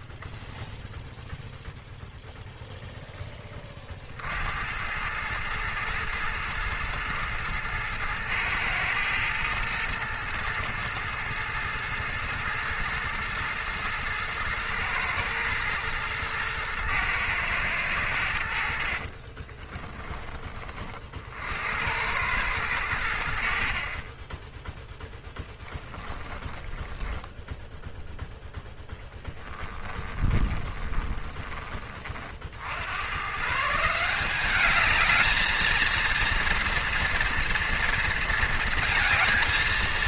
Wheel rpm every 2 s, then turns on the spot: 0, 0, 100, 110, 110, 110, 120, 110, 110, 50, 40, 90, 10, 10, 10, 10, 80, 210, 230, 230.
18-20 28-32